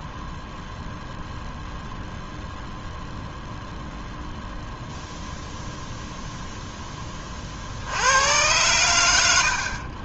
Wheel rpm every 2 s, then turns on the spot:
0, 0, 0, 0, 110.
none